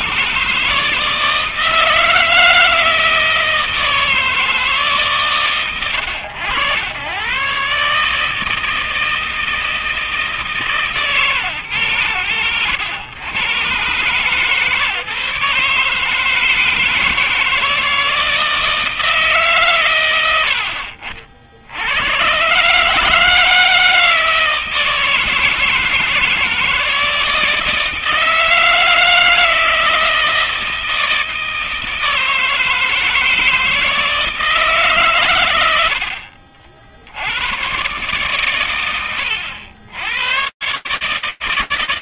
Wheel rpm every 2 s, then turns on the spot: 140, 160, 140, 90, 160, 140, 90, 140, 160, 160, 80, 130, 160, 160, 160, 160, 160, 150, 80, 110, 130.
none